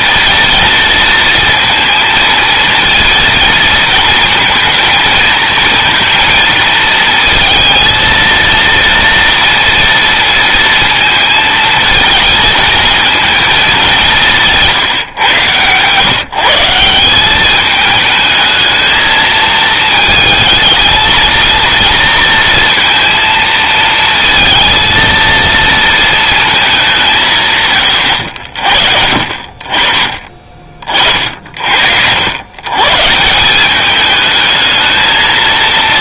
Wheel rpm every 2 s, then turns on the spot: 230, 230, 230, 230, 230, 230, 220, 150, 170, 220, 220, 230, 230, 190, 50, 30, 120, 220.
none